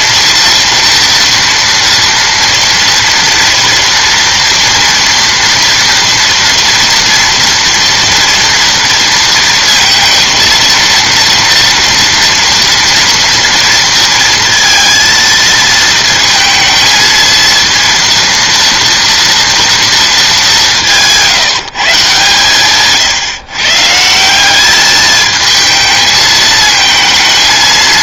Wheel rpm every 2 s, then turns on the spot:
230, 230, 230, 230, 230, 230, 230, 230, 230, 230, 180, 140, 200, 220.
none